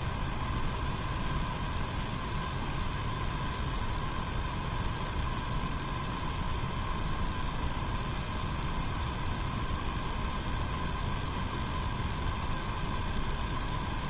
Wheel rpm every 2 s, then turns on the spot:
0, 0, 0, 0, 0, 0, 0.
none